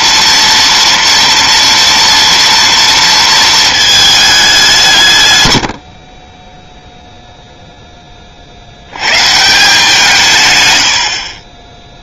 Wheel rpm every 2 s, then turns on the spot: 230, 230, 190, 0, 110, 60.
none